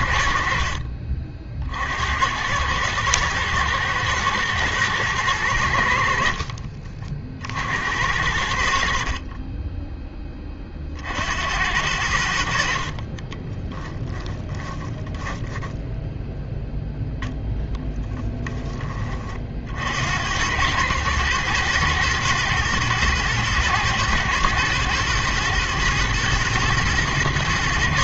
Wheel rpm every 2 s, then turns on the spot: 50, 100, 110, 50, 70, 30, 60, 10, 0, 10, 100, 110, 120, 120.
6-8 14-16